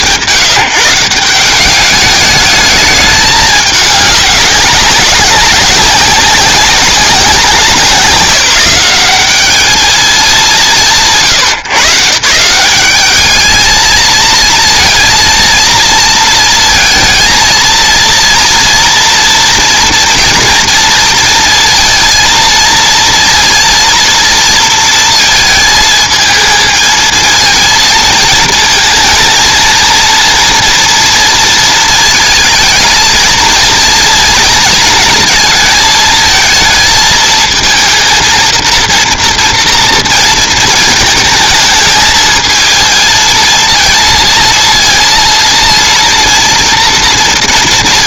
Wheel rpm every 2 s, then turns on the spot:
150, 210, 190, 190, 180, 150, 200, 230, 230, 230, 230, 230, 230, 220, 220, 230, 230, 220, 220, 230, 220, 220, 230, 230.
none